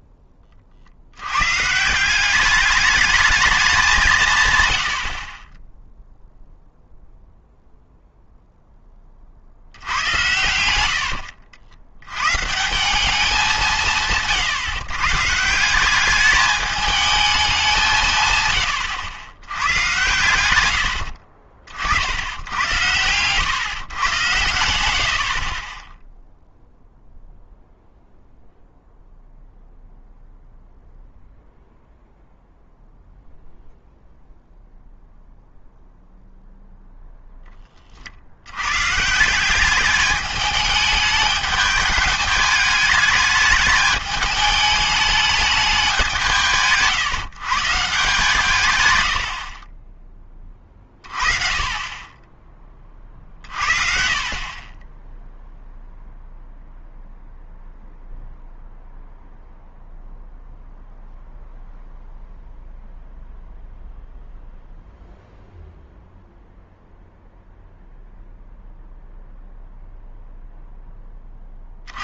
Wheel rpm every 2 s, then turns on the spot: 40, 200, 110, 0, 0, 80, 160, 140, 210, 100, 90, 100, 100, 0, 0, 0, 0, 0, 0, 100, 210, 210, 210, 160, 130, 20, 30, 20, 0, 0, 0, 0, 0, 0, 0, 0.
none